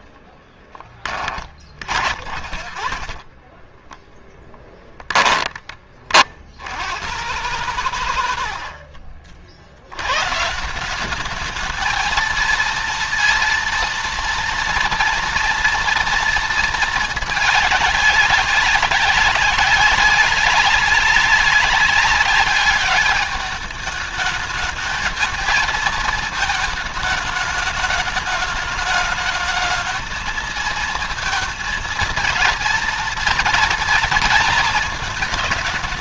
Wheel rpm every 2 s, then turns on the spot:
30, 30, 10, 90, 60, 170, 230, 230, 220, 200, 200, 200, 220, 210, 210, 230, 230, 220.
0-4